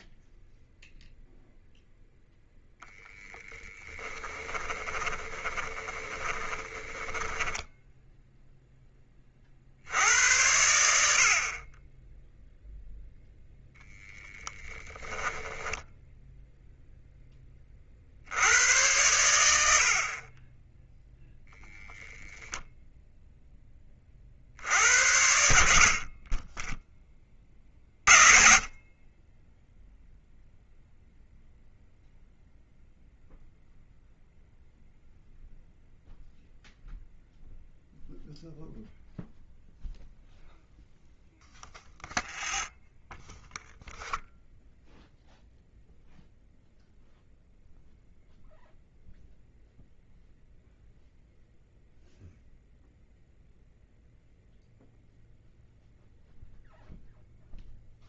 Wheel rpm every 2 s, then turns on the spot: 0, 0, 20, 10, 10, 70, 0, 10, 0, 100, 10, 0, 60, 20, 30, 0, 0, 0, 0, 0, 0, 0, 0, 0, 0, 0, 0, 0, 0.
4-8